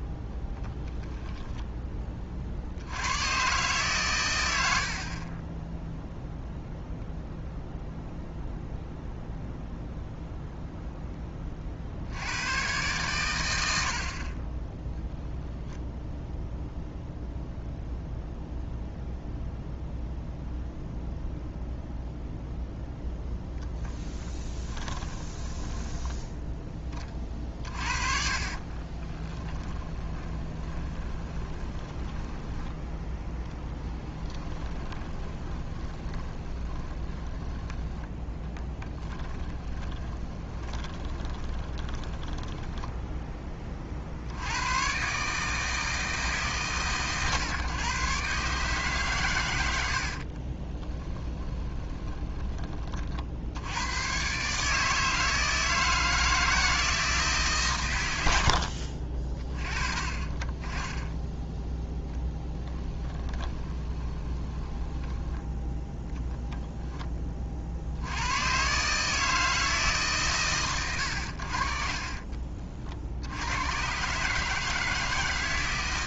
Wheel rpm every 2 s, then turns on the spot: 10, 100, 40, 0, 0, 0, 120, 0, 0, 0, 0, 0, 10, 30, 20, 20, 0, 20, 20, 20, 20, 10, 130, 130, 130, 10, 30, 160, 160, 40, 20, 10, 10, 0, 150, 100, 60, 160.
24-26 28-32 34-42 50-52 62-66